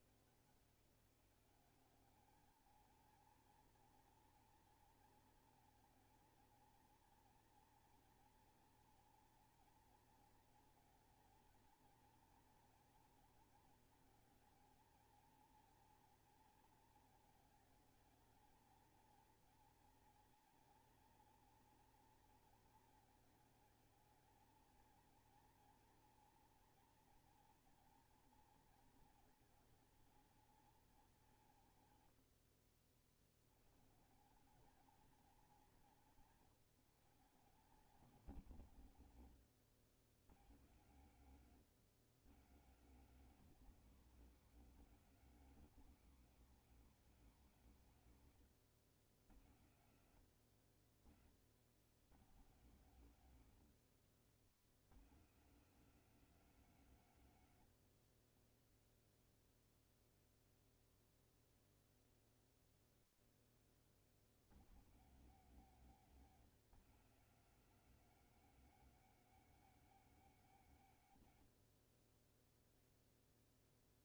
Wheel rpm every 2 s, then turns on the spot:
160, 210, 230, 230, 230, 230, 230, 230, 230, 220, 240, 230, 220, 230, 230, 220, 90, 170, 170, 210, 140, 170, 240, 230, 140, 90, 160, 90, 230, 30, 0, 0, 100, 220, 250, 220, 10.
32-34 58-60